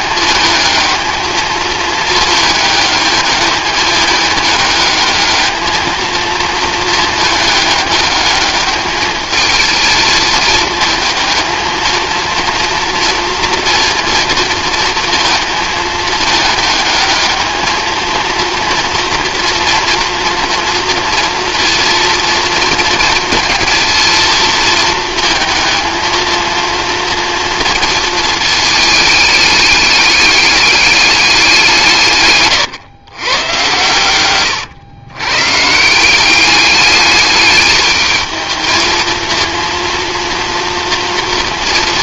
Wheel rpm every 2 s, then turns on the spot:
220, 210, 210, 220, 210, 220, 230, 230, 210, 230, 230, 230, 230, 230, 220, 210, 130, 110, 200, 220, 230.
none